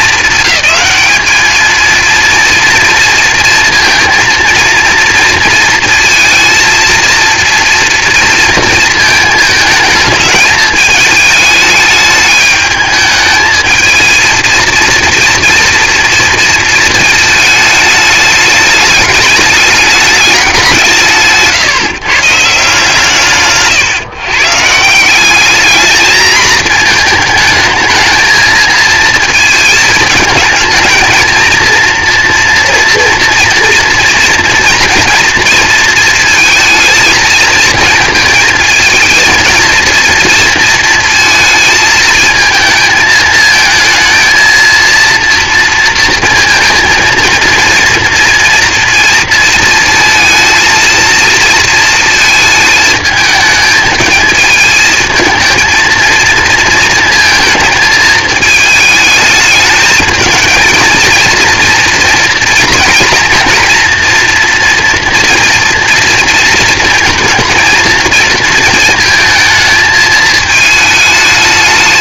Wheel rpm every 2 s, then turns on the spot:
200, 230, 230, 220, 230, 220, 210, 230, 230, 210, 190, 150, 140, 220, 220, 220, 240, 240, 230, 230, 230, 220, 230, 230, 230, 230, 220, 220, 230, 220, 230, 230, 240, 230, 220, 220.
none